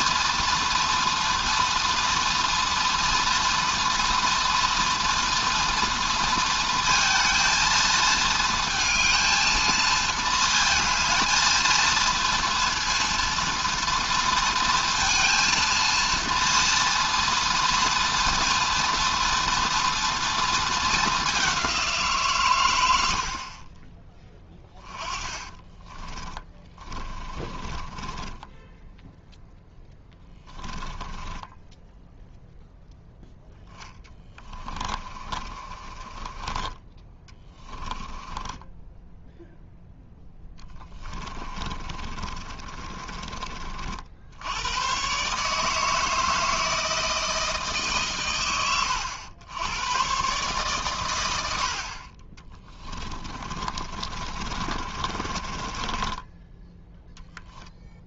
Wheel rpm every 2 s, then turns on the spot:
230, 230, 230, 230, 230, 220, 230, 230, 230, 230, 220, 90, 10, 20, 10, 10, 0, 30, 20, 10, 20, 30, 120, 160, 100, 120, 30, 40, 10.
26-28 30-32 34-44 52-56